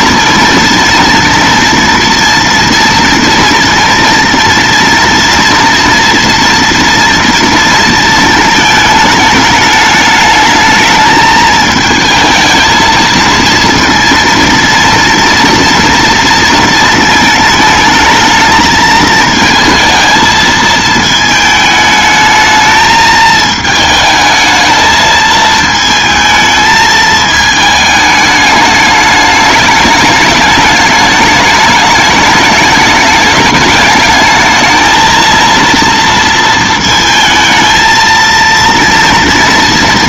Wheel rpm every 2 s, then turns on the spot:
230, 230, 230, 230, 210, 220, 230, 230, 220, 220, 220, 220, 220, 220, 210, 210, 210, 220, 230, 230.
none